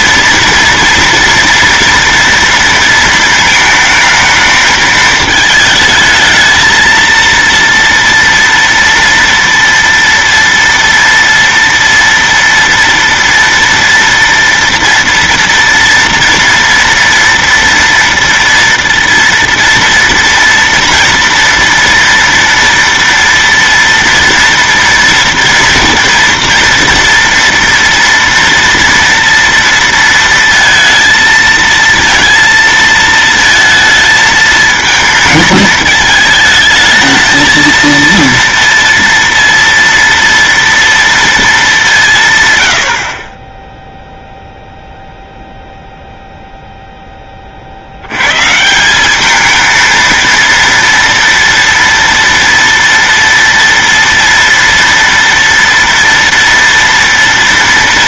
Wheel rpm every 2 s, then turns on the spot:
230, 230, 220, 220, 230, 230, 230, 230, 230, 230, 230, 230, 230, 230, 230, 230, 230, 220, 220, 230, 230, 130, 0, 0, 150, 230, 230, 230, 230.
none